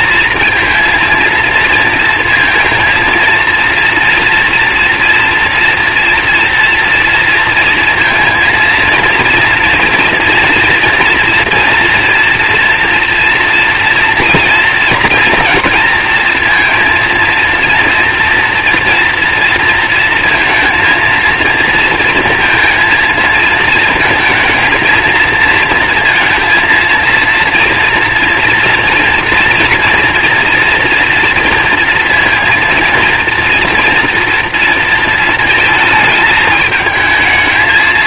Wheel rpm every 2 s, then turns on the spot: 230, 230, 230, 230, 230, 240, 230, 240, 230, 230, 230, 230, 230, 230, 230, 230, 230, 230, 220.
none